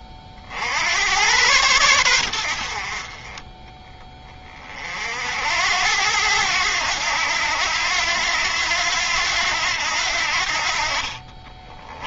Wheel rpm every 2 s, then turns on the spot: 90, 50, 50, 90, 90, 50.
none